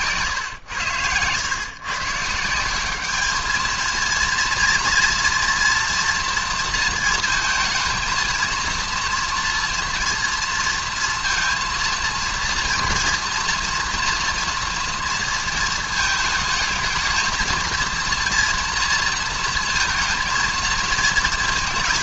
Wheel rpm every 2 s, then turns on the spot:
100, 190, 230, 230, 230, 230, 230, 230, 220, 230, 220.
none